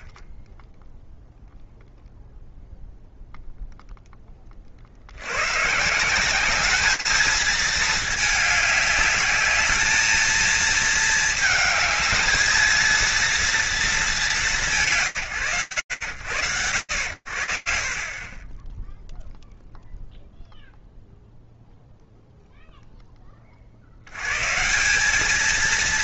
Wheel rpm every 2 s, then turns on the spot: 0, 0, 110, 220, 210, 220, 220, 110, 60, 0, 0, 100, 230.
none